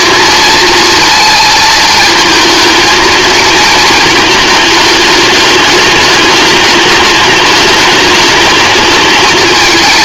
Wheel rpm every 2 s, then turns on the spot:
230, 230, 210, 210, 220.
none